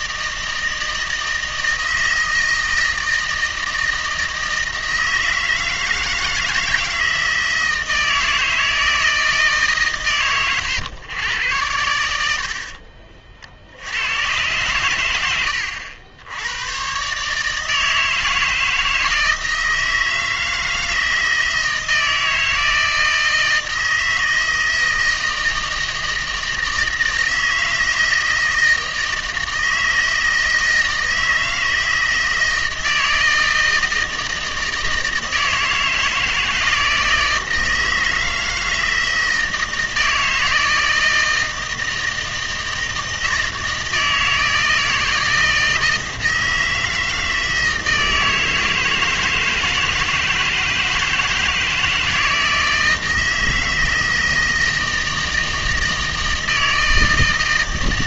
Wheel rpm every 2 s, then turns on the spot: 160, 160, 160, 160, 160, 110, 40, 110, 120, 160, 160, 160, 160, 160, 160, 160, 160, 160, 160, 160, 160, 160, 160, 160, 160, 160, 160, 160, 160.
12-14